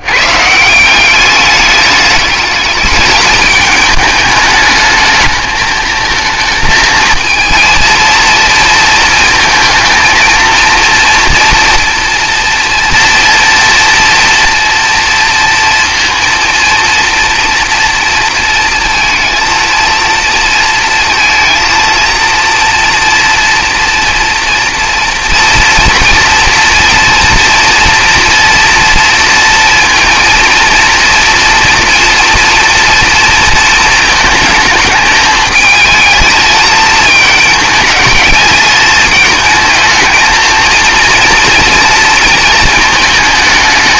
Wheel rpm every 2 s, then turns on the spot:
180, 210, 220, 230, 230, 230, 230, 230, 230, 230, 230, 230, 230, 230, 230, 230, 230, 220, 220, 220, 230, 220.
none